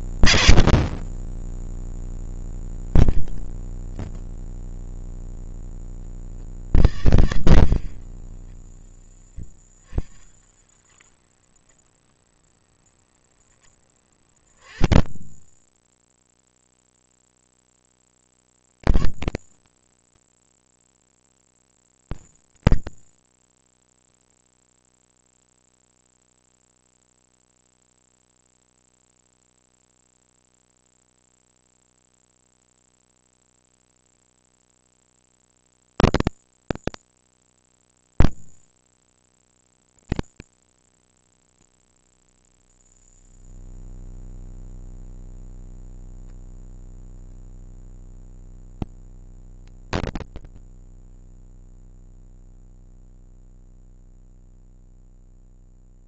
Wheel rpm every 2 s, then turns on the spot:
80, 30, 40, 130, 20, 0, 10, 20, 0, 80, 20, 80, 0, 0, 0, 0, 10, 10, 30, 130, 180, 40, 10, 40, 170, 60, 0, 0.
2-4 8-10 12-16 34-38 42-44 46-48 50-52